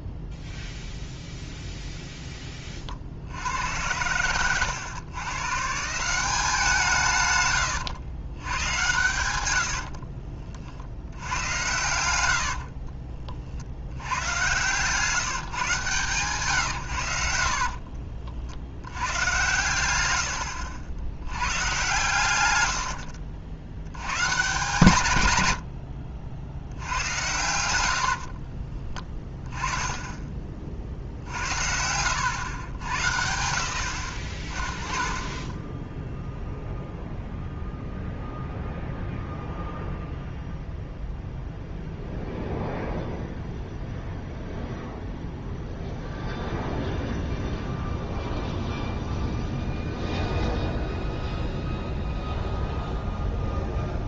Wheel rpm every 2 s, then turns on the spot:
0, 20, 110, 180, 110, 50, 70, 130, 130, 70, 80, 90, 140, 80, 30, 40, 100, 30, 0, 0, 0, 0, 0, 0, 0, 0, 0.
12-14 28-30